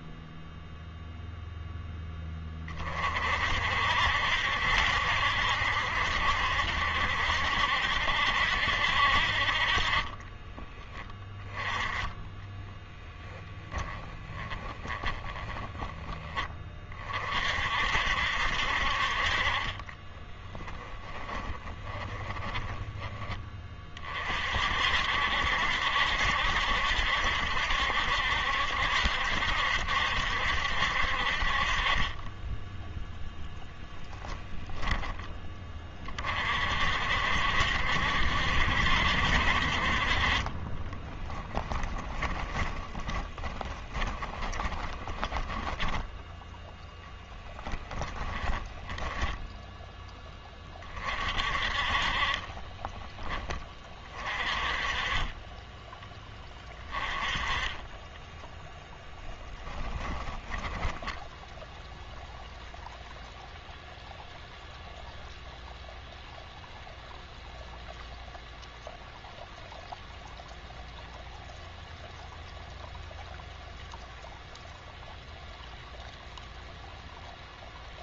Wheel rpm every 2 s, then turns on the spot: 0, 20, 70, 70, 70, 20, 10, 20, 30, 60, 10, 30, 50, 70, 70, 70, 10, 10, 50, 70, 30, 20, 20, 10, 10, 30, 20, 30, 20, 0, 10, 0, 0, 0, 0, 0, 0, 0, 0.
12-16 20-24 34-36 42-46 48-50 52-54 60-62